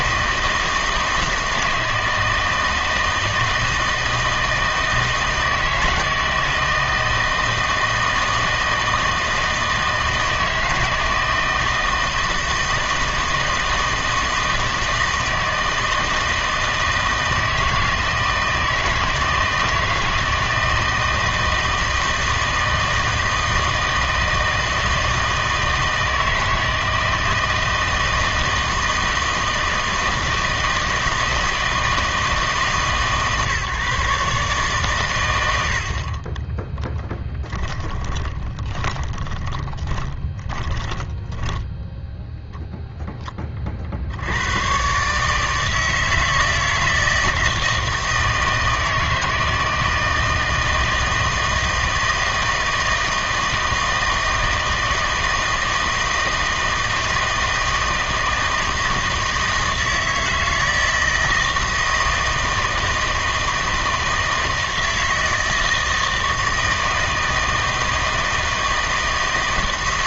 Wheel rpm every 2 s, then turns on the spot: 160, 160, 160, 160, 160, 160, 160, 160, 160, 160, 160, 160, 160, 160, 160, 160, 150, 140, 10, 30, 20, 0, 110, 160, 160, 160, 160, 160, 160, 160, 160, 160, 160, 160, 160.
36-42